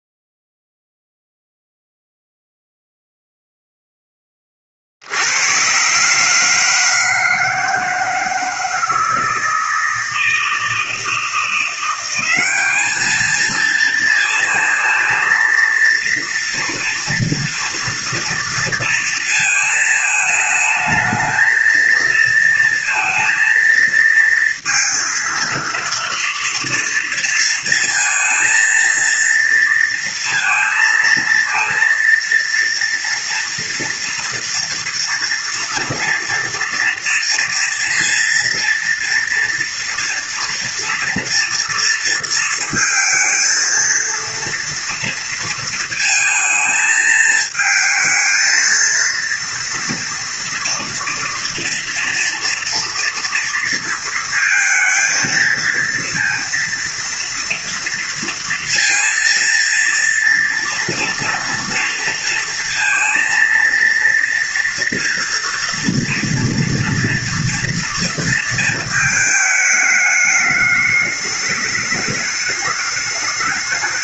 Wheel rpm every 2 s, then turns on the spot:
0, 0, 60, 160, 160, 160, 210, 230, 230, 230, 220, 230, 230, 230, 230, 230, 230, 240, 230, 230, 230, 230, 230, 220, 230, 230, 230, 230, 230, 230, 230, 230, 230, 230, 220, 210, 210.
none